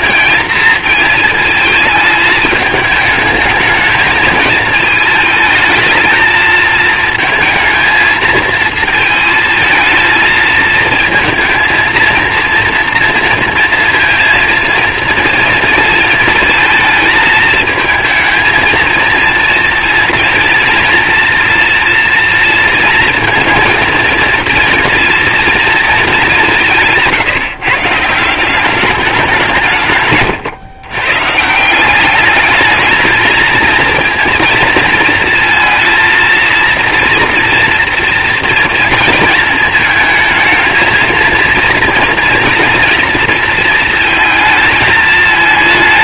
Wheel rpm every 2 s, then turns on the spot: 230, 220, 220, 220, 220, 220, 230, 230, 220, 230, 240, 230, 230, 150, 190, 140, 220, 230, 230, 230, 230, 230, 220.
none